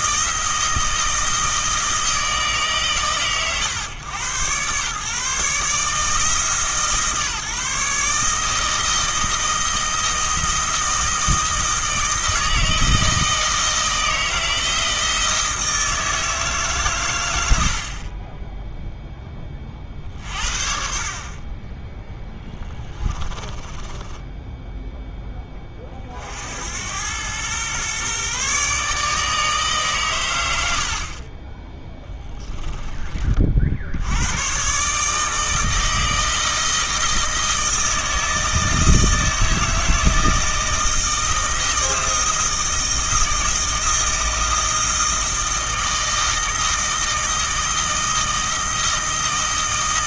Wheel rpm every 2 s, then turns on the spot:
160, 140, 130, 150, 160, 160, 160, 160, 150, 10, 50, 20, 0, 80, 150, 70, 10, 130, 160, 160, 160, 160, 160, 160, 160.
22-24